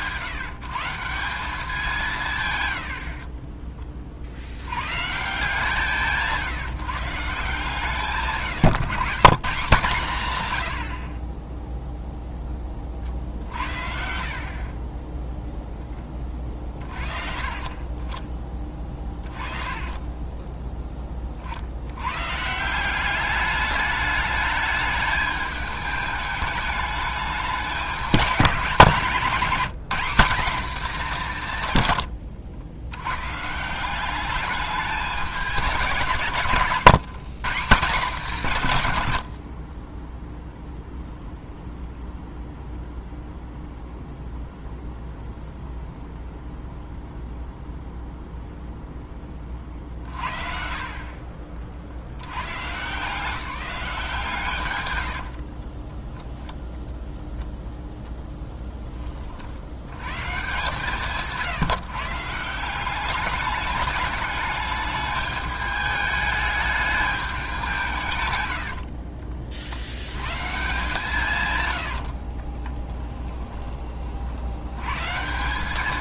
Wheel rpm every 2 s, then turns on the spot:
170, 80, 120, 150, 130, 60, 40, 20, 50, 20, 20, 180, 210, 210, 200, 220, 110, 200, 140, 110, 0, 0, 0, 0, 0, 40, 140, 100, 10, 10, 140, 190, 210, 210, 70, 150, 20, 100.
14-16 18-20 54-56 68-70 72-74